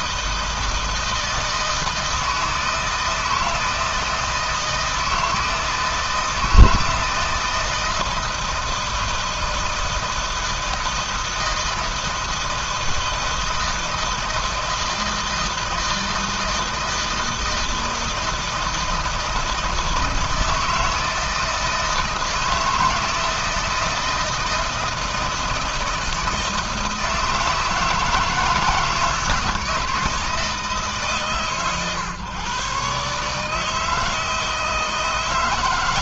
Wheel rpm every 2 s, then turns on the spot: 160, 160, 160, 160, 160, 160, 160, 160, 160, 160, 160, 160, 160, 160, 160, 160, 130, 160.
none